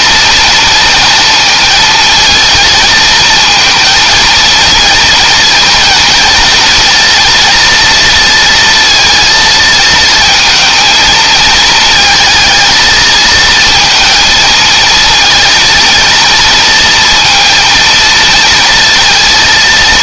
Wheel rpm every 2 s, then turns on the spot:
230, 220, 230, 230, 230, 230, 220, 230, 230, 230.
none